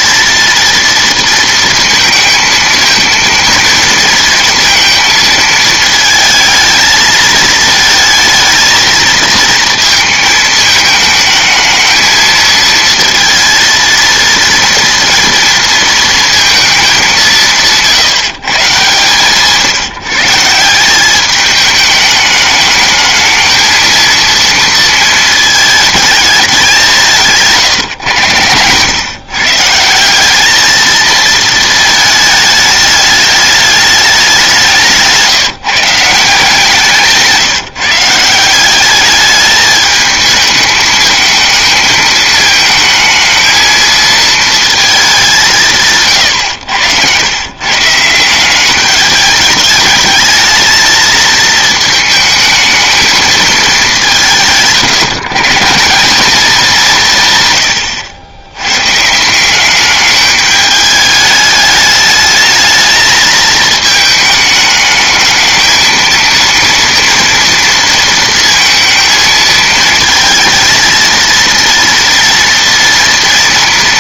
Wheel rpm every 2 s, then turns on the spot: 230, 220, 230, 220, 220, 220, 230, 230, 220, 150, 180, 210, 230, 200, 110, 210, 220, 180, 160, 190, 210, 220, 220, 100, 190, 220, 220, 150, 200, 120, 210, 220, 210, 230, 220, 220, 230.
none